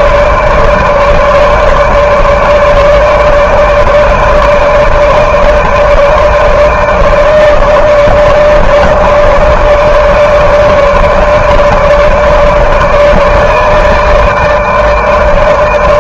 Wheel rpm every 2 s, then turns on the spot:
150, 150, 160, 160, 150, 150, 150, 160.
none